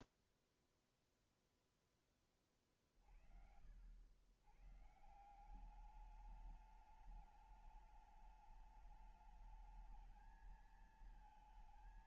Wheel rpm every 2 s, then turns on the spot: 0, 20, 80, 200, 210, 220.
none